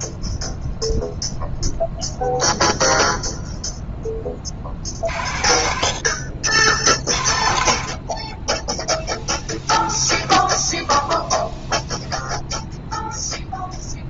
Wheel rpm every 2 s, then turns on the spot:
0, 0, 50, 50, 20, 10, 0.
none